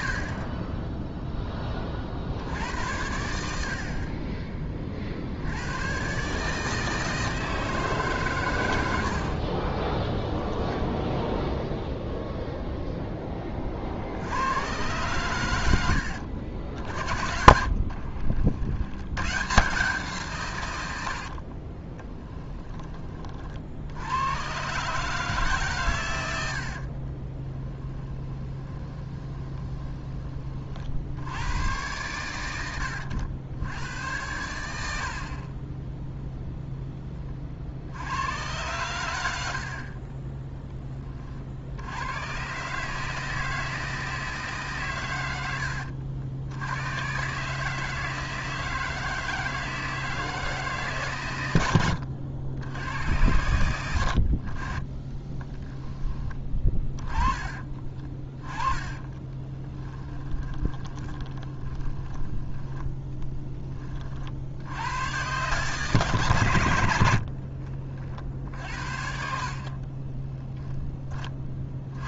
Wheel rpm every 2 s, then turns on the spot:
20, 80, 40, 160, 100, 10, 0, 120, 60, 80, 100, 10, 130, 50, 20, 30, 110, 80, 20, 110, 10, 140, 140, 100, 160, 150, 80, 30, 20, 20, 10, 10, 90, 90, 60, 10.
10-12 16-18 26-30 34-36 58-62